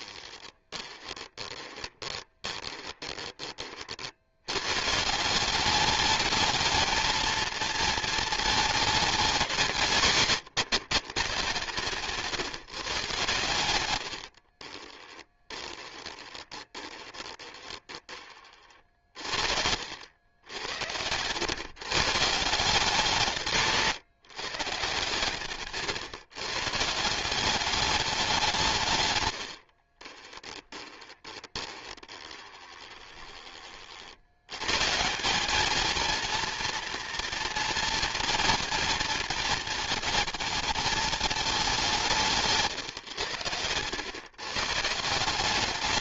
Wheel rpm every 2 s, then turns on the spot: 20, 20, 130, 230, 220, 150, 140, 40, 20, 40, 90, 170, 150, 150, 150, 20, 20, 130, 230, 230, 220, 140, 150.
0-4 14-20 30-34